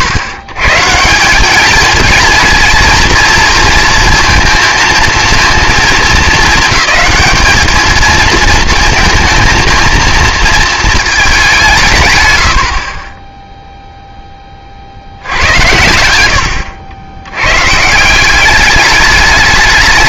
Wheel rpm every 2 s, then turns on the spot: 120, 220, 230, 210, 230, 220, 60, 50, 90, 210.
12-14